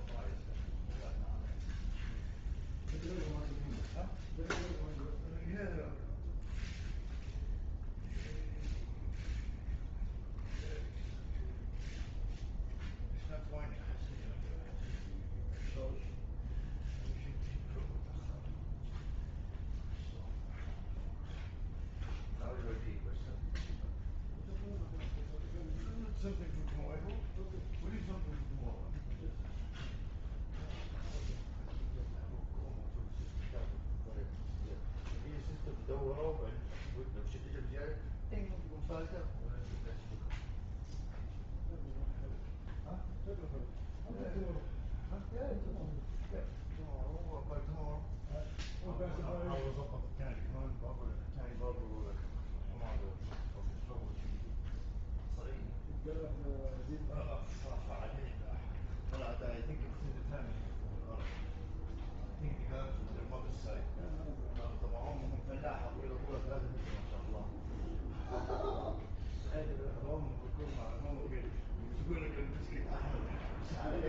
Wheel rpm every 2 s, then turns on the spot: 0, 0, 0, 0, 0, 0, 0, 0, 0, 0, 0, 0, 0, 0, 0, 0, 0, 0, 0, 0, 0, 0, 0, 0, 0, 0, 0, 0, 0, 0, 0, 0, 0, 0, 0, 0, 0.
none